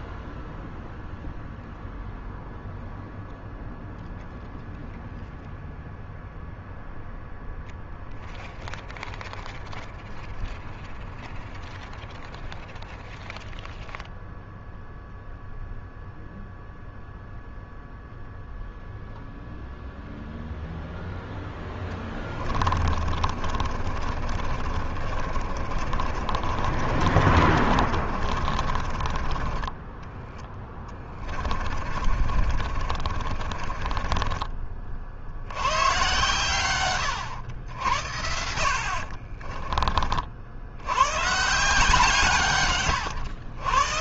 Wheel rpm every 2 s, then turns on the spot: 0, 0, 0, 0, 0, 0, 0, 0, 0, 0, 0, 30, 40, 40, 30, 20, 40, 70, 110, 50, 120, 110.
22-34 38-40